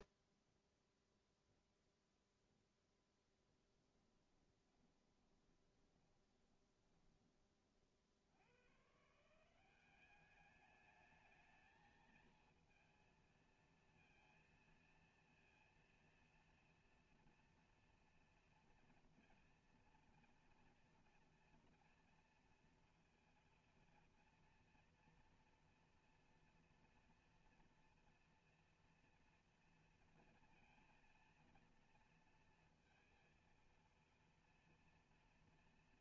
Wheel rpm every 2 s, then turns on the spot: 0, 0, 20, 30, 90, 200, 230, 230, 230, 230, 230, 230, 230, 230, 230, 230, 230, 230.
4-8